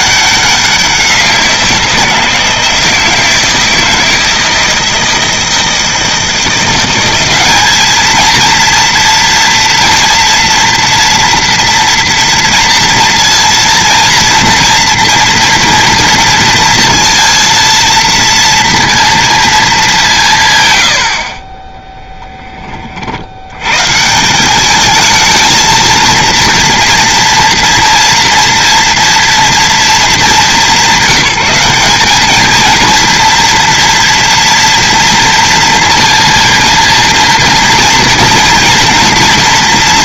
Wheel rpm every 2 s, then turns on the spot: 180, 160, 160, 180, 230, 230, 230, 230, 230, 230, 110, 40, 210, 230, 230, 200, 230, 230, 230, 240.
none